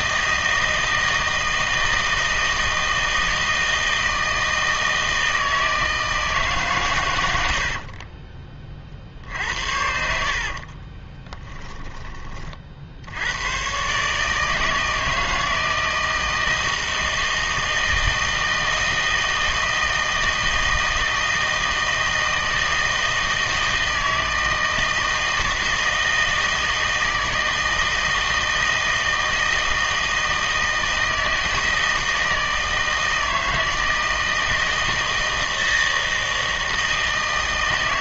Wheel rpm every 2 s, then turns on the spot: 160, 160, 160, 140, 40, 40, 50, 160, 170, 160, 160, 160, 160, 160, 160, 160, 160, 160, 160.
10-12